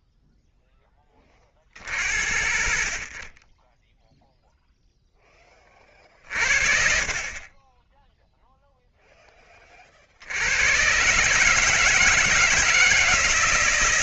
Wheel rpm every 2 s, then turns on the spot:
50, 10, 30, 10, 30, 150, 160.
6-8